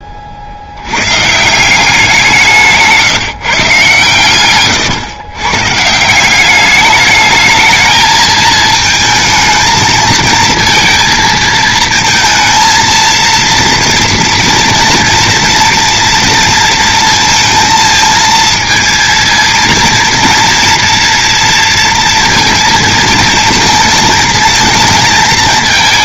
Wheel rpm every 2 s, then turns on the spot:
70, 170, 120, 200, 220, 230, 230, 230, 230, 230, 230, 230, 230.
none